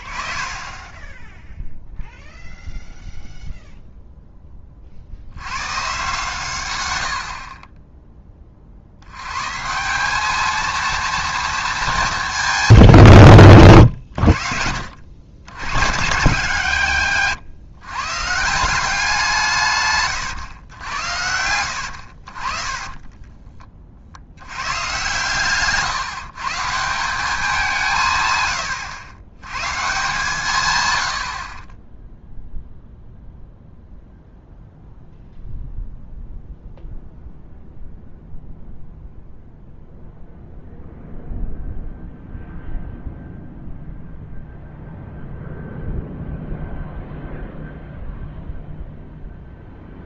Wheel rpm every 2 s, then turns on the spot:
20, 0, 20, 120, 40, 230, 160, 60, 150, 160, 110, 40, 100, 150, 120, 140, 0, 0, 0, 0, 0, 0, 0, 0, 0.
0-2 28-30